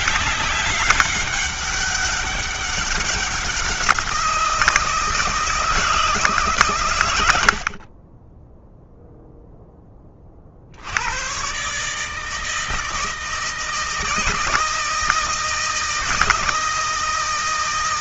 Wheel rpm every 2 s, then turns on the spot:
200, 190, 160, 120, 0, 70, 160, 160, 160.
6-8